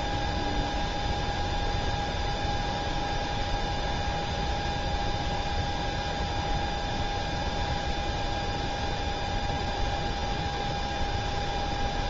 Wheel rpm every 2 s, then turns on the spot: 0, 0, 0, 0, 0, 0.
none